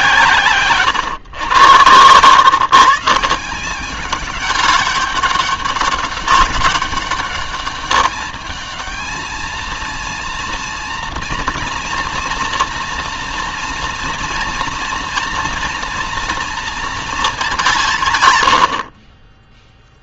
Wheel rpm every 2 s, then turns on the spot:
130, 150, 200, 200, 220, 230, 230, 230, 220, 60.
none